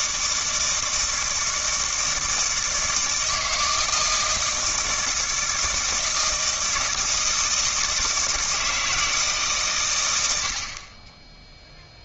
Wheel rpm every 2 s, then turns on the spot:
160, 160, 160, 160, 160, 70.
none